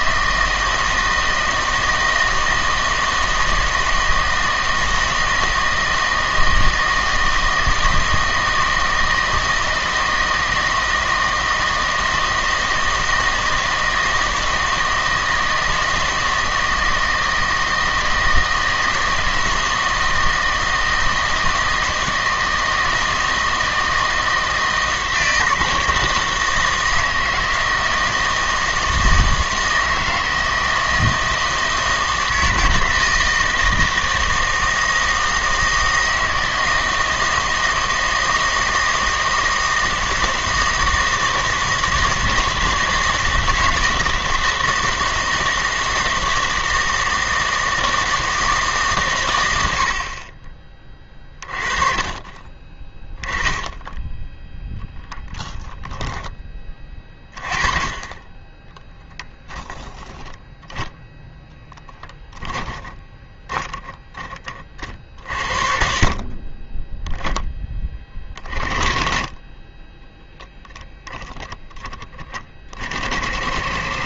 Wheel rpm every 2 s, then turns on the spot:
160, 160, 160, 160, 160, 160, 160, 160, 160, 160, 160, 160, 160, 160, 160, 160, 160, 160, 160, 160, 160, 160, 160, 160, 150, 30, 20, 0, 20, 10, 10, 10, 40, 20, 30, 10, 40.
58-64